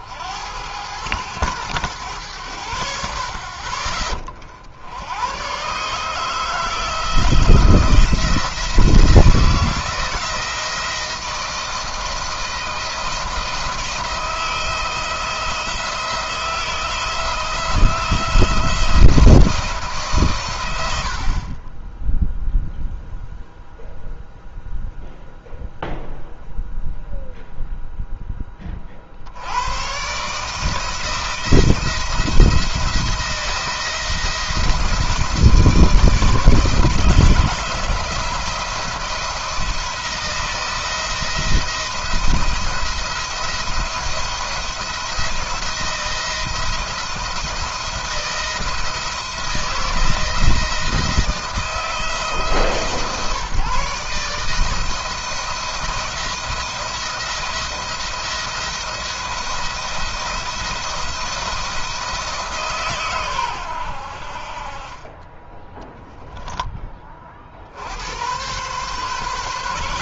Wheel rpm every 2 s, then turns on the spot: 90, 80, 70, 160, 170, 160, 170, 160, 160, 170, 120, 0, 0, 0, 30, 150, 170, 160, 160, 170, 160, 170, 170, 170, 170, 160, 150, 160, 170, 170, 170, 140, 40, 20, 120.
none